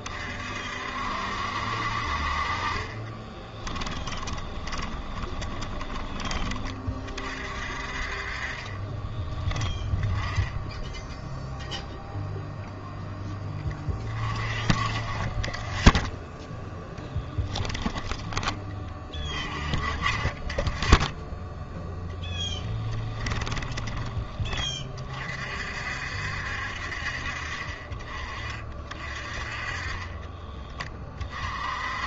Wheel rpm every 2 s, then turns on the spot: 60, 30, 20, 30, 20, 0, 0, 30, 0, 20, 10, 10, 30, 50, 40, 30.
2-6 8-10 20-24